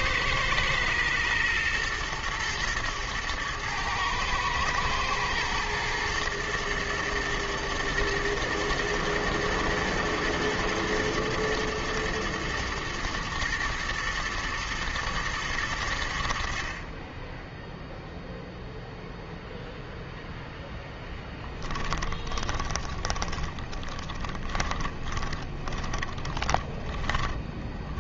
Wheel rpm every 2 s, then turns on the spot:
110, 120, 120, 120, 110, 110, 110, 110, 40, 0, 10, 20, 30, 30.
22-28